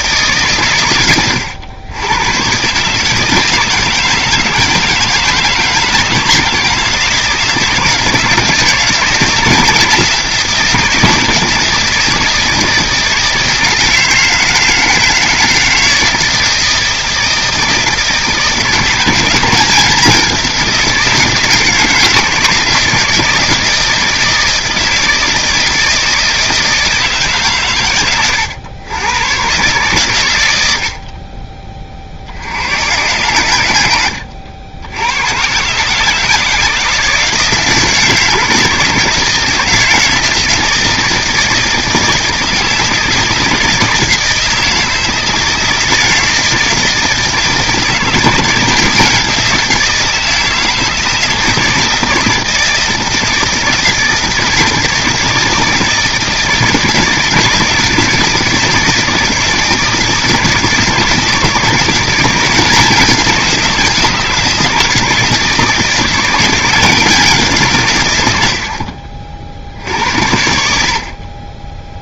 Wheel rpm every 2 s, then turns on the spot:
120, 140, 160, 160, 160, 170, 160, 160, 160, 170, 180, 160, 160, 160, 100, 80, 100, 80, 160, 160, 160, 160, 160, 160, 170, 160, 160, 160, 160, 160, 160, 180, 160, 180, 70, 60.
none